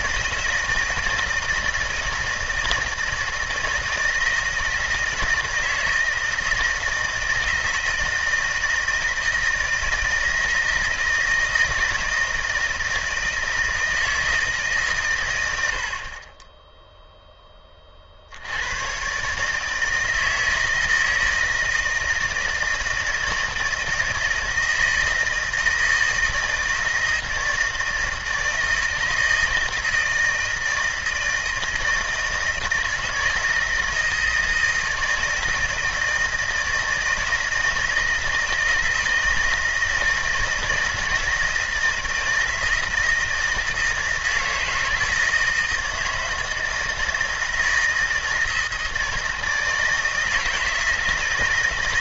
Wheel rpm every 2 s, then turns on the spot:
160, 160, 160, 160, 160, 160, 160, 130, 10, 130, 160, 160, 160, 160, 160, 160, 160, 160, 160, 160, 160, 160, 160, 160, 160, 160.
none